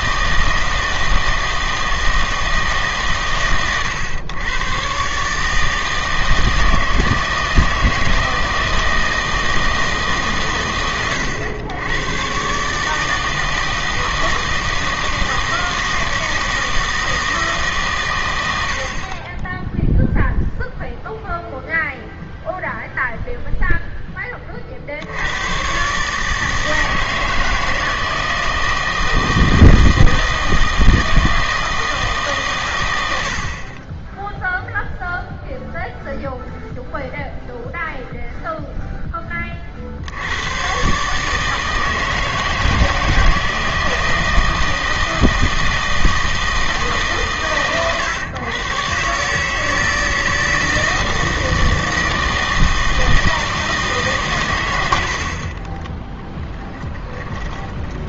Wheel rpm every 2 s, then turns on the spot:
160, 150, 120, 160, 160, 120, 140, 160, 160, 80, 0, 0, 50, 160, 160, 160, 110, 0, 0, 0, 120, 160, 160, 160, 120, 160, 160, 110, 10.
56-58